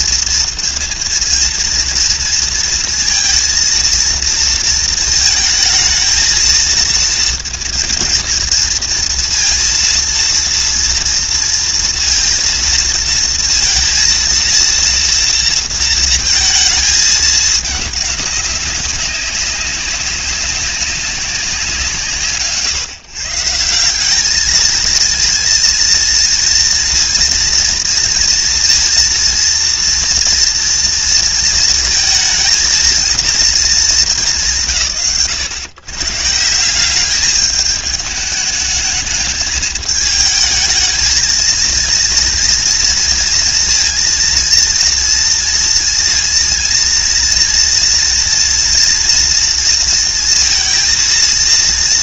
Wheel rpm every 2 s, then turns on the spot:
230, 230, 220, 230, 230, 230, 230, 230, 220, 190, 180, 140, 230, 230, 230, 230, 230, 120, 190, 220, 220, 230, 230, 230, 230, 230.
none